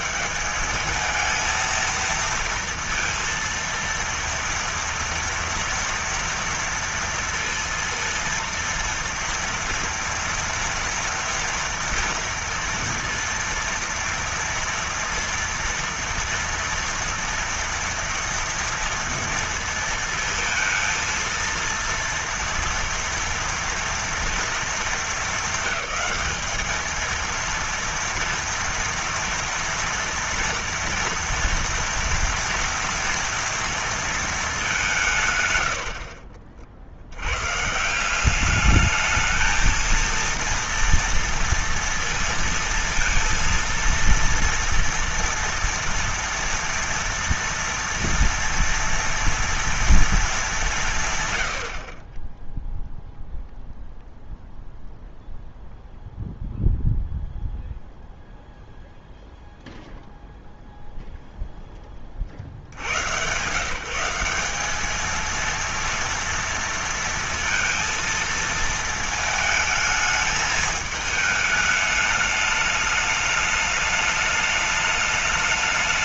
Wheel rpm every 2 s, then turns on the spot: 200, 230, 230, 230, 230, 240, 230, 230, 230, 230, 230, 230, 230, 220, 230, 230, 230, 200, 50, 200, 230, 230, 230, 230, 230, 190, 0, 0, 0, 0, 0, 60, 200, 230, 230, 220, 210, 210.
none